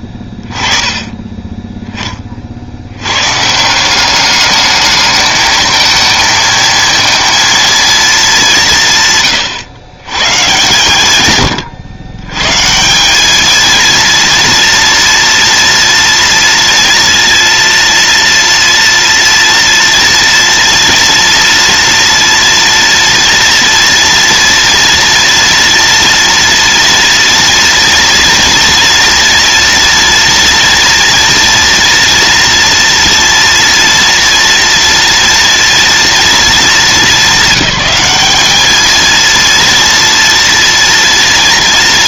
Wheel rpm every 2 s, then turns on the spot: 20, 90, 210, 230, 160, 140, 170, 230, 230, 230, 230, 240, 240, 240, 230, 230, 230, 230, 210, 220, 230.
none